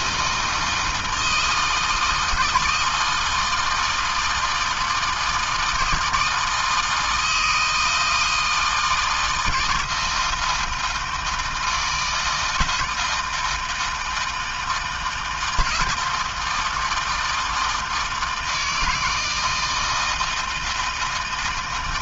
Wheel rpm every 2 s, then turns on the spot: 160, 160, 160, 160, 160, 160, 160, 160, 160, 160, 140.
none